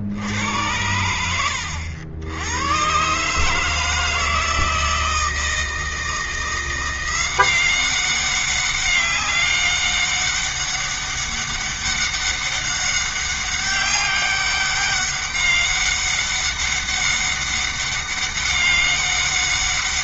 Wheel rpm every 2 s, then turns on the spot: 90, 120, 160, 170, 200, 200, 200, 200, 200, 200.
none